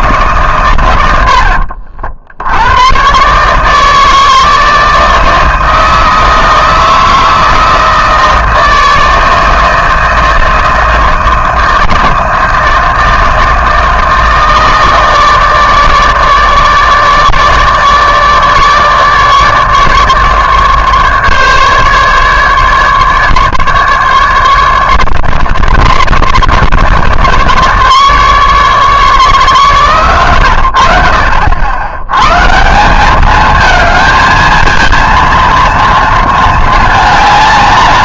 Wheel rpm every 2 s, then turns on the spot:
120, 90, 160, 160, 160, 160, 160, 160, 150, 150, 150, 150, 150, 150, 150, 90, 160, 230, 220.
none